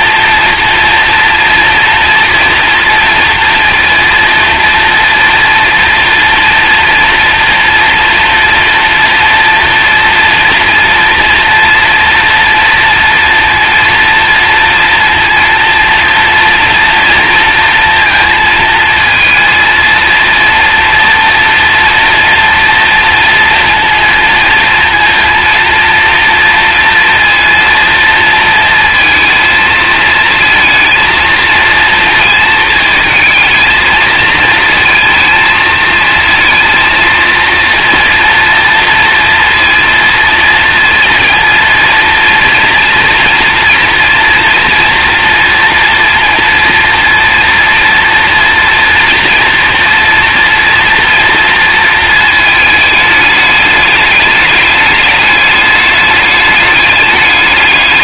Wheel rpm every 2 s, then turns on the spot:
230, 230, 230, 240, 230, 240, 230, 230, 230, 230, 230, 230, 230, 230, 230, 220, 230, 230, 230, 230, 230, 230, 240, 230, 230, 230, 220, 210, 210.
none